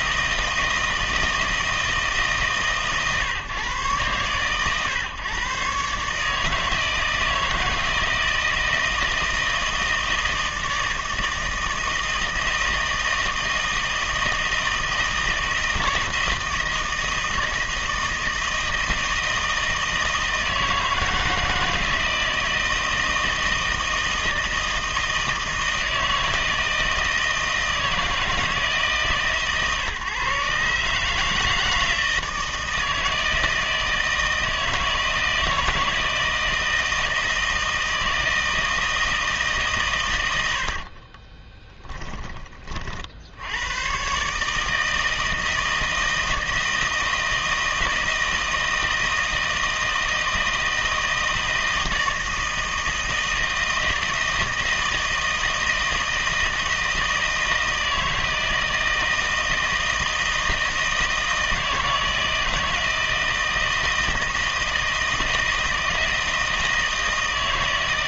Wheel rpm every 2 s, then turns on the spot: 160, 150, 120, 150, 160, 160, 160, 160, 160, 160, 160, 160, 160, 160, 160, 140, 160, 160, 160, 160, 120, 10, 140, 160, 160, 160, 160, 160, 160, 160, 160, 160, 160, 160.
none